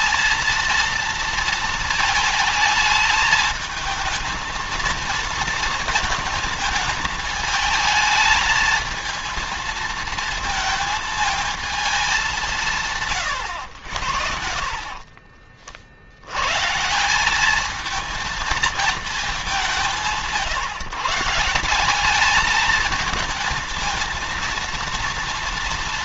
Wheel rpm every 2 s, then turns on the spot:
230, 220, 230, 220, 220, 220, 150, 40, 150, 220, 160, 220, 230.
14-16